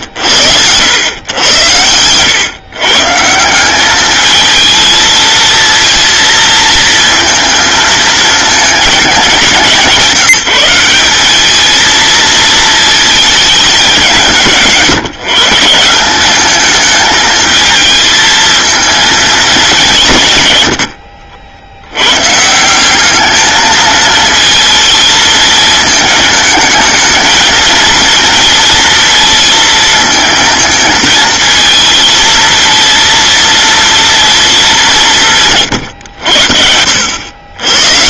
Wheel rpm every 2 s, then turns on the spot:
90, 130, 220, 230, 220, 190, 220, 170, 210, 220, 120, 160, 230, 220, 230, 220, 230, 220, 80.
none